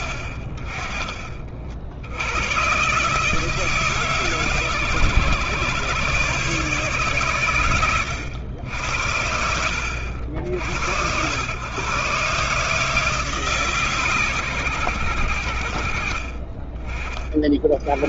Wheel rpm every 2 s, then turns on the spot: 60, 110, 150, 140, 90, 70, 140, 130, 20.
none